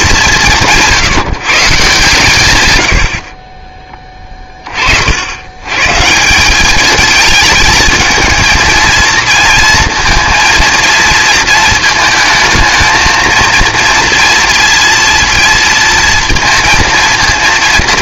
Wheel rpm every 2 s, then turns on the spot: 180, 110, 40, 200, 220, 230, 220, 230, 230.
none